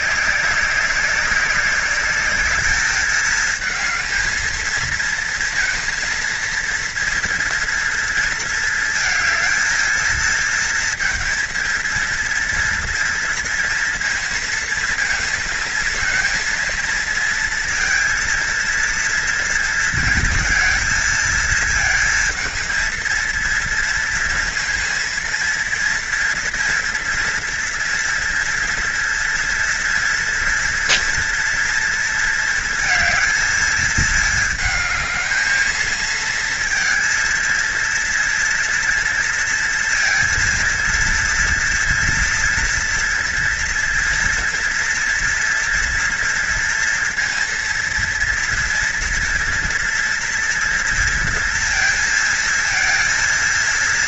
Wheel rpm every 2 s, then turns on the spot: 190, 210, 220, 230, 230, 230, 230, 230, 230, 230, 230, 220, 230, 230, 230, 230, 220, 220, 230, 230, 230, 230, 230, 230, 230, 230, 230.
none